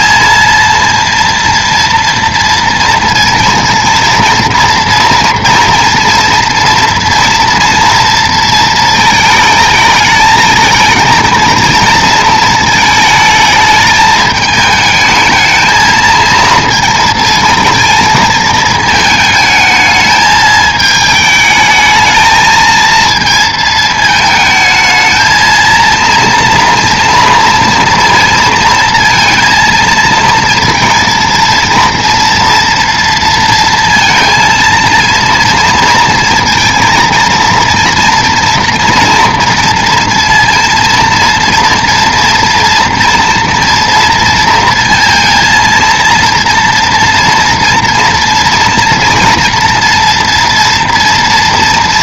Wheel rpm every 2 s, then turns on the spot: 230, 230, 240, 240, 230, 220, 220, 210, 220, 220, 220, 220, 220, 230, 230, 230, 230, 230, 230, 240, 230, 230, 230, 230, 230, 230.
none